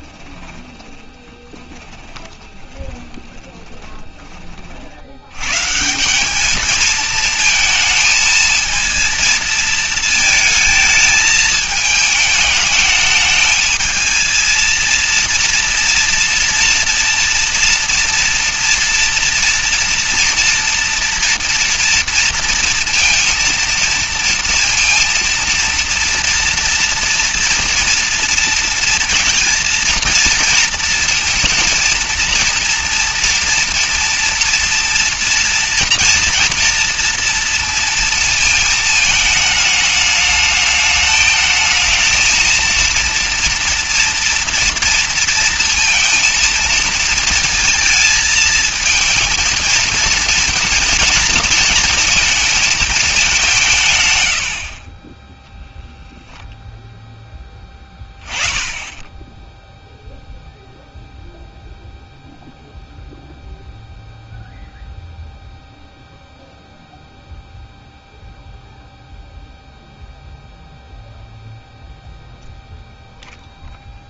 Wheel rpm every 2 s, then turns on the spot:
10, 10, 40, 210, 220, 220, 220, 220, 230, 230, 230, 230, 230, 230, 230, 230, 230, 230, 230, 220, 210, 230, 230, 230, 230, 230, 220, 80, 0, 10, 0, 0, 0, 0, 0, 0, 0.
0-4 54-56